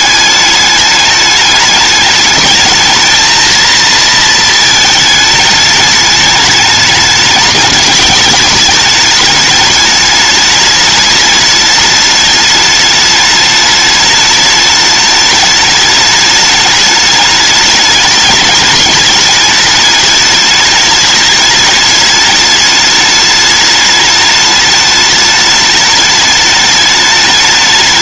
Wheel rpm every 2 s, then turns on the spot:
210, 220, 220, 210, 210, 210, 210, 210, 210, 210, 210, 210, 210, 210.
none